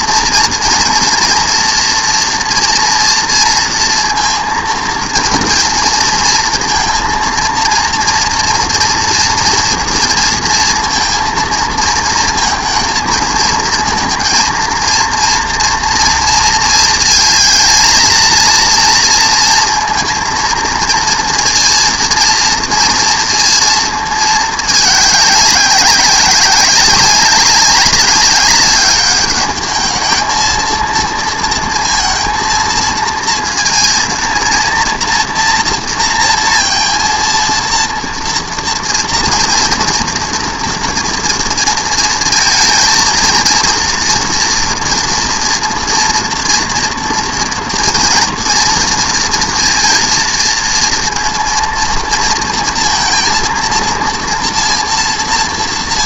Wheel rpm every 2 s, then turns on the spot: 240, 230, 230, 230, 230, 230, 230, 230, 230, 230, 230, 230, 210, 190, 200, 220, 230, 230, 230, 230, 230, 230, 230, 230, 230, 230, 230, 240.
none